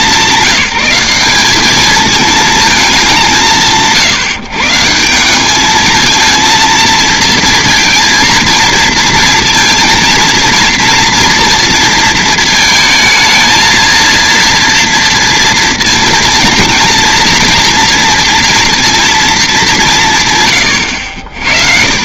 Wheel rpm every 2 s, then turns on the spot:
190, 210, 150, 230, 230, 230, 220, 230, 230, 230, 110.
none